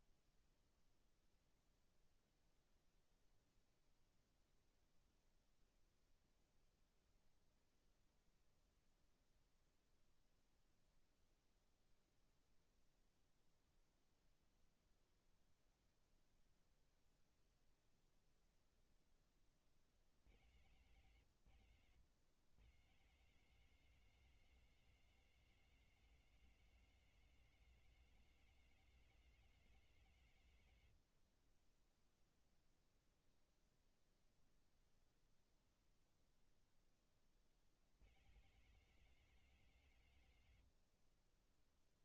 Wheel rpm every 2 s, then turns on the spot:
0, 0, 0, 0, 0, 0, 0, 0, 0, 0, 100, 110, 190, 190, 190, 130, 0, 0, 0, 150, 150.
none